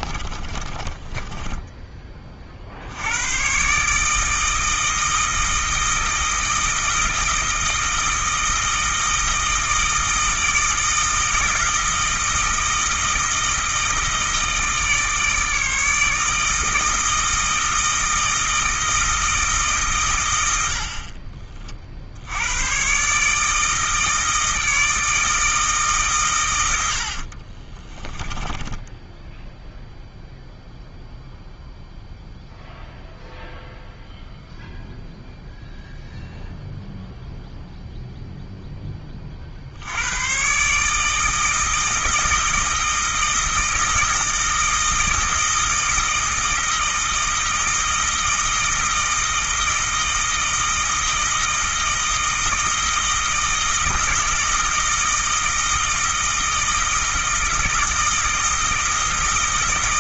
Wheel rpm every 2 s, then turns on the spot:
30, 60, 160, 160, 160, 160, 160, 160, 160, 160, 80, 120, 160, 90, 10, 0, 0, 0, 0, 10, 140, 160, 160, 160, 160, 160, 160, 160, 160, 160.
0-2 28-30